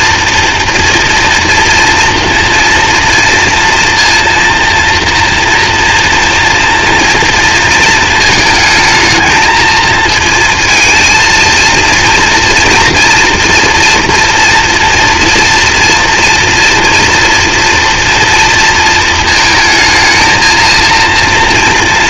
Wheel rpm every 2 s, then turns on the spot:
240, 230, 230, 230, 220, 230, 230, 230, 240, 230, 230.
none